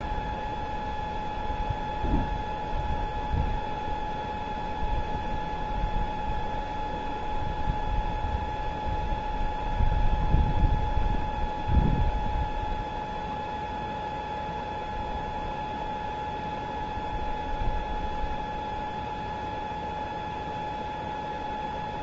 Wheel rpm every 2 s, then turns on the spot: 0, 0, 0, 0, 0, 0, 0, 0, 0, 0, 0.
none